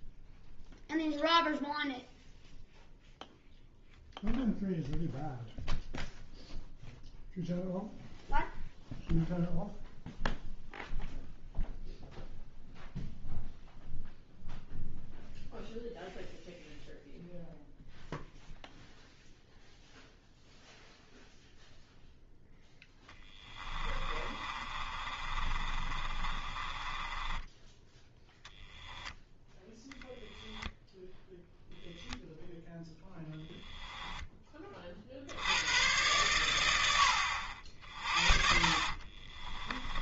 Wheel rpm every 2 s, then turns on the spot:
0, 0, 0, 0, 0, 0, 0, 0, 0, 0, 0, 0, 30, 20, 0, 0, 10, 40, 90, 40.
24-28 32-34 38-40